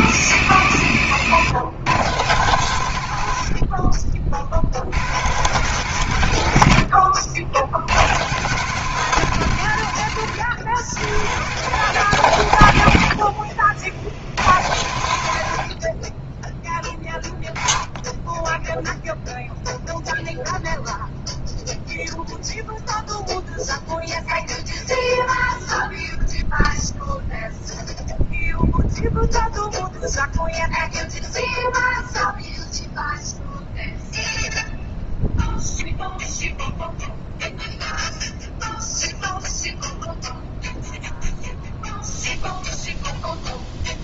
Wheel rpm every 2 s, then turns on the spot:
100, 130, 70, 90, 140, 100, 100, 90, 10, 10, 0, 0, 0, 0, 0, 0, 0, 0, 0, 0, 0, 0.
none